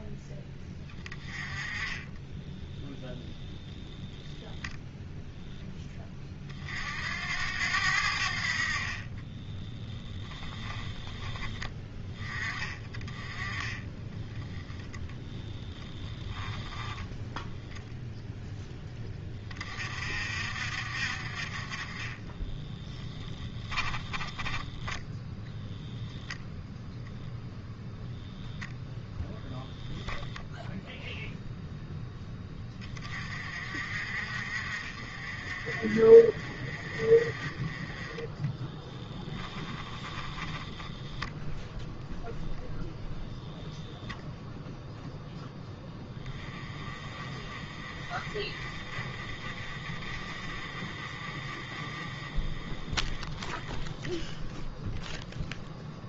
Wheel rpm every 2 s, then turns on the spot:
10, 10, 0, 50, 40, 10, 20, 10, 10, 10, 50, 10, 10, 0, 0, 0, 20, 40, 40, 10, 10, 0, 0, 20, 30, 30, 20, 0.
14-18 22-26 38-42